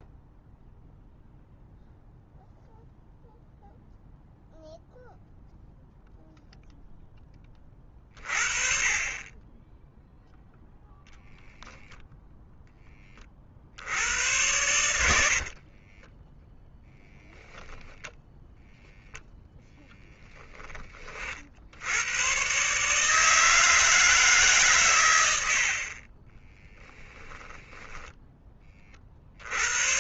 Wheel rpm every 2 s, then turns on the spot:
0, 0, 0, 0, 40, 0, 0, 90, 10, 0, 10, 120, 150, 30, 20.
16-18 26-30